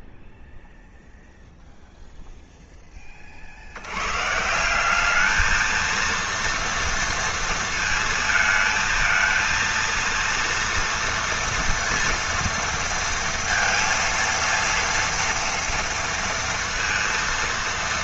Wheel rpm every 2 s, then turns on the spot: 0, 10, 170, 230, 220, 230, 230, 230, 230.
none